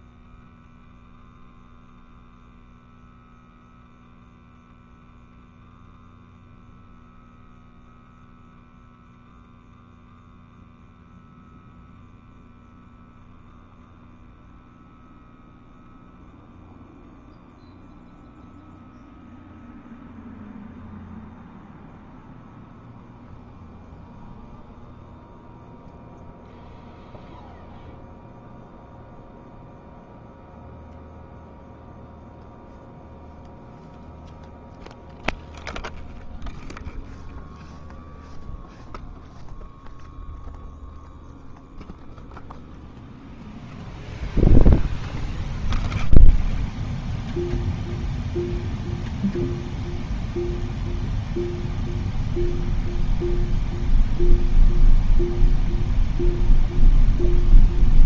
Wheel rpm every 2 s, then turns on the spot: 0, 0, 0, 0, 0, 0, 0, 0, 0, 0, 0, 0, 0, 0, 0, 0, 0, 0, 0, 0, 0, 0, 0, 0, 0, 0, 0, 0, 0.
none